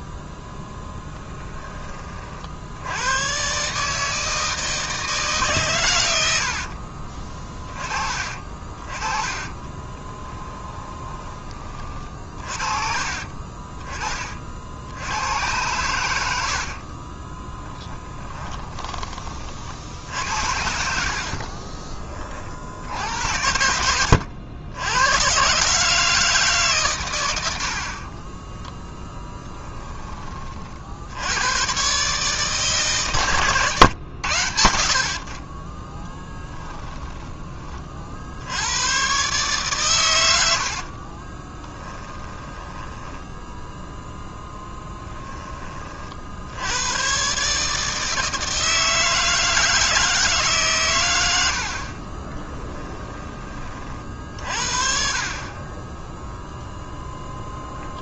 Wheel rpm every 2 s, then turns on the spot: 10, 70, 160, 60, 40, 20, 50, 60, 60, 20, 60, 50, 90, 150, 30, 40, 150, 90, 10, 80, 80, 10, 10, 80, 160, 140, 20, 50, 0.
6-12 16-18 36-38 42-46 52-54